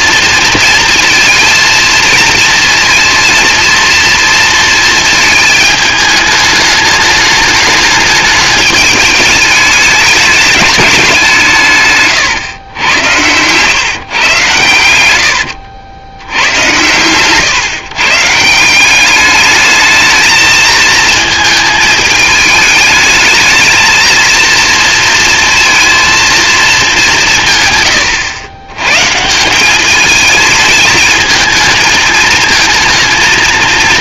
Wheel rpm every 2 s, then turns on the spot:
230, 230, 220, 210, 210, 200, 90, 100, 110, 170, 220, 210, 230, 220, 120, 220, 220.
none